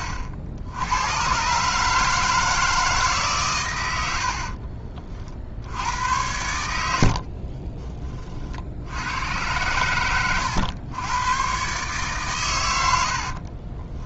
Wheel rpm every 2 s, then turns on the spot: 80, 160, 40, 80, 60, 110, 80.
4-6 12-14